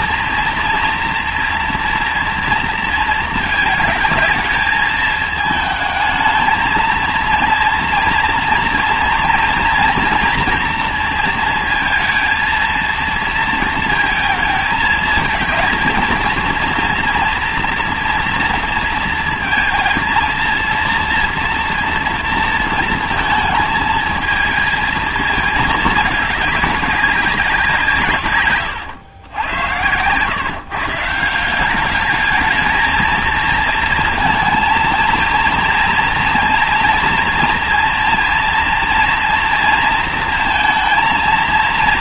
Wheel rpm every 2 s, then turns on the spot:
230, 230, 220, 220, 230, 230, 230, 220, 230, 230, 230, 230, 230, 200, 110, 140, 220, 230, 240, 230, 230.
none